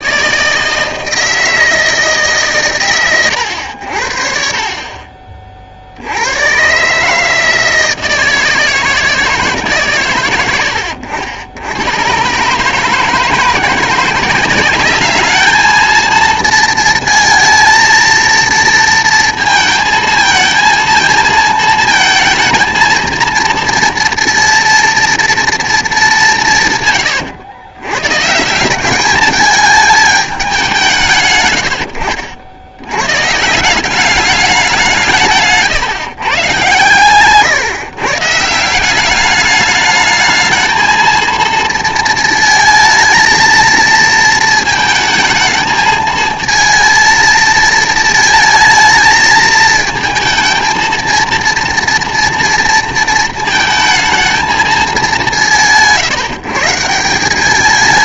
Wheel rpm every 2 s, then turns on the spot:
160, 140, 40, 130, 160, 90, 150, 200, 230, 230, 220, 230, 230, 150, 180, 190, 100, 180, 120, 170, 220, 220, 220, 230, 220, 230, 230, 220, 160.
none